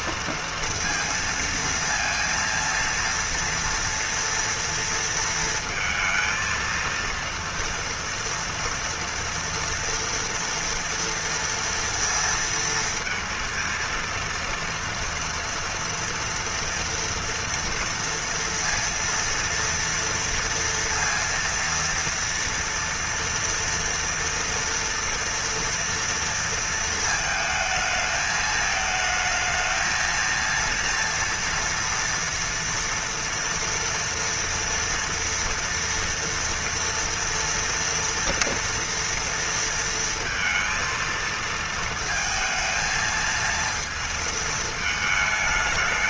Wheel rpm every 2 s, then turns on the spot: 230, 230, 230, 230, 240, 240, 230, 230, 230, 230, 230, 230, 230, 230, 220, 230, 240, 230, 230, 230, 230, 220, 220.
none